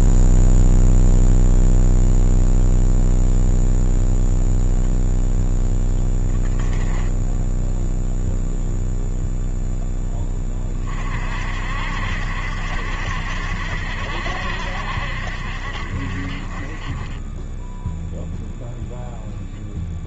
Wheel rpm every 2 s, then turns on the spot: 0, 0, 0, 10, 0, 30, 70, 60, 30, 0.
6-8